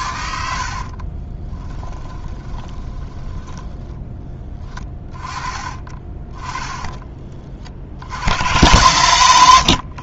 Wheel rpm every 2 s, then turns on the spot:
60, 20, 20, 20, 110.
0-4 6-8